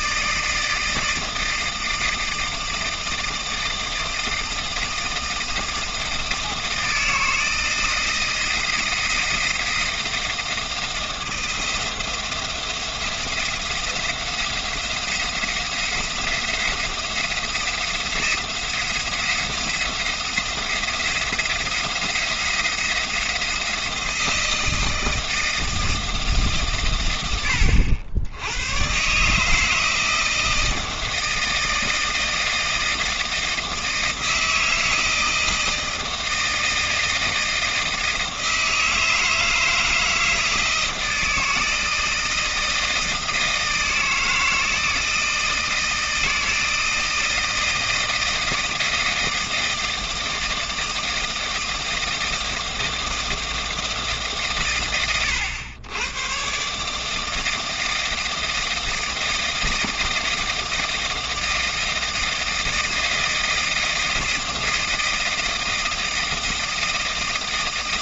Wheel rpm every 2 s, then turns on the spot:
160, 160, 160, 160, 160, 160, 170, 170, 170, 170, 170, 170, 160, 130, 100, 160, 160, 160, 160, 160, 160, 160, 160, 160, 160, 160, 160, 90, 140, 160, 160, 160, 160, 160.
none